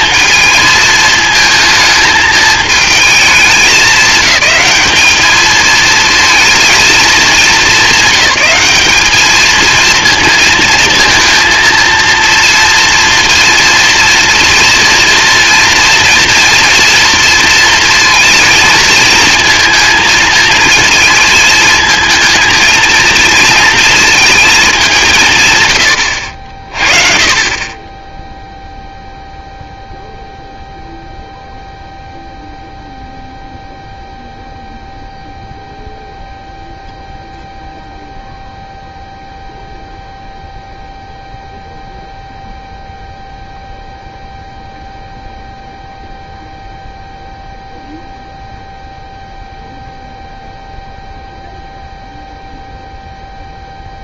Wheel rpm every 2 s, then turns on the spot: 220, 220, 200, 220, 200, 220, 230, 230, 230, 230, 230, 230, 210, 40, 0, 0, 0, 0, 0, 0, 0, 0, 0, 0, 0, 0, 0.
none